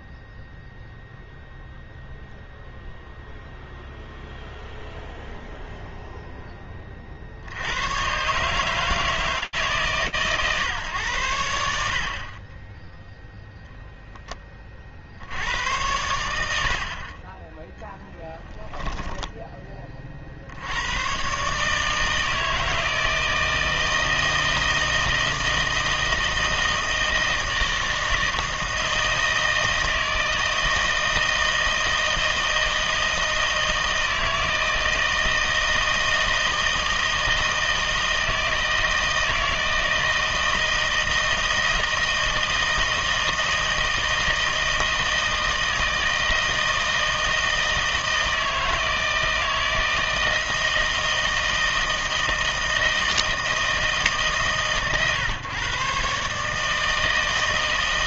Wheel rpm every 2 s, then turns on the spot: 0, 0, 0, 10, 150, 130, 20, 20, 80, 10, 110, 160, 160, 160, 160, 160, 160, 160, 160, 160, 160, 160, 160, 160, 160, 160, 160, 140, 160.
18-20